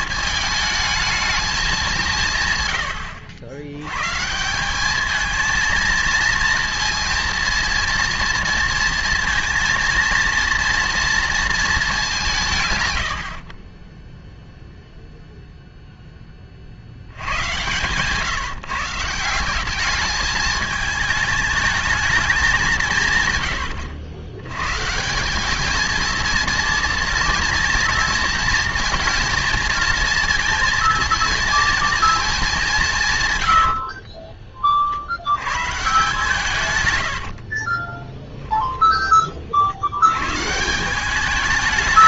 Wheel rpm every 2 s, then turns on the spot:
220, 140, 180, 230, 230, 230, 150, 0, 30, 150, 220, 200, 110, 230, 230, 230, 210, 40, 130, 10, 150.
38-40